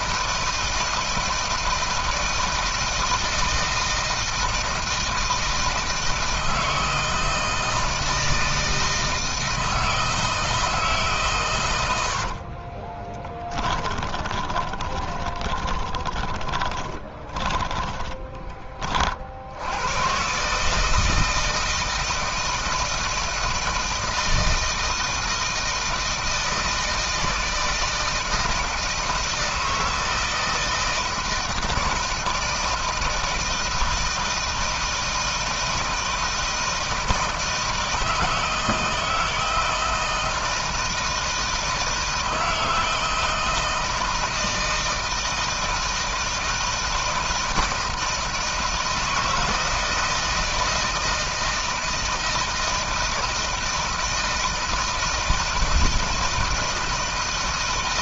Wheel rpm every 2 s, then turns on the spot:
160, 160, 160, 160, 160, 160, 50, 20, 10, 20, 150, 160, 160, 160, 160, 160, 160, 160, 160, 160, 160, 160, 160, 160, 160, 160, 160, 160, 160.
12-18